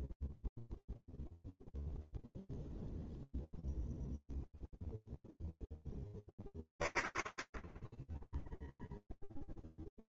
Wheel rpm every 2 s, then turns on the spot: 0, 0, 20, 0, 0.
none